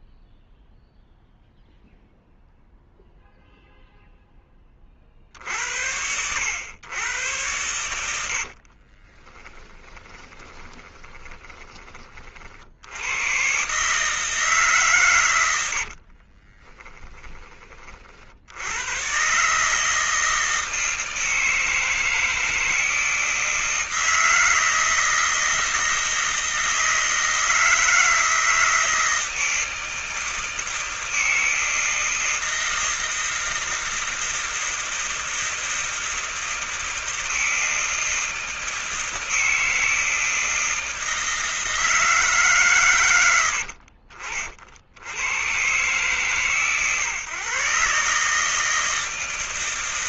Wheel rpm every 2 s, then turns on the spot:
0, 0, 10, 90, 70, 20, 50, 150, 40, 70, 160, 160, 160, 160, 160, 160, 160, 160, 160, 160, 160, 150, 50, 140, 150.
8-12 16-18